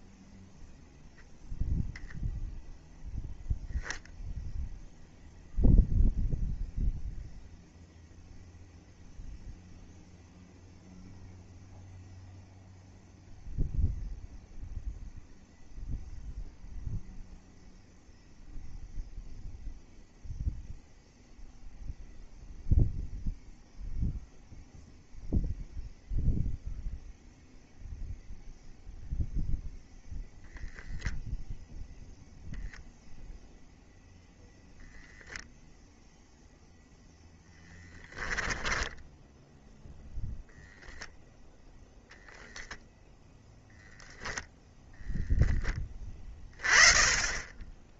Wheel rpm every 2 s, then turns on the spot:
0, 0, 0, 0, 0, 0, 0, 0, 0, 0, 0, 0, 0, 0, 0, 0, 0, 0, 10, 0, 0, 0, 20, 0.
36-38